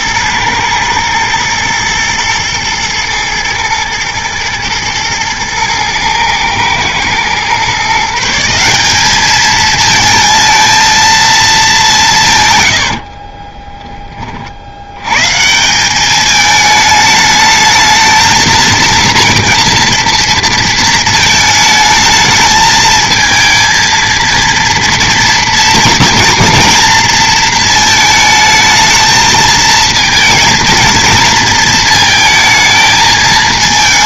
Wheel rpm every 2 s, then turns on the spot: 110, 120, 110, 110, 180, 230, 130, 60, 220, 220, 220, 220, 230, 230, 220, 230, 220.
none